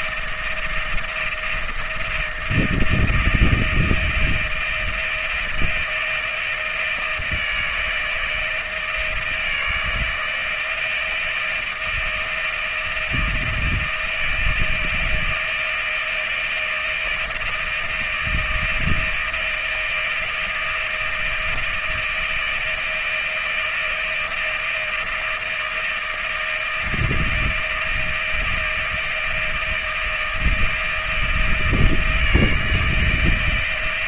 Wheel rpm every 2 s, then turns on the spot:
160, 170, 160, 160, 160, 160, 160, 160, 160, 170, 160, 160, 170, 160, 160, 160, 170.
none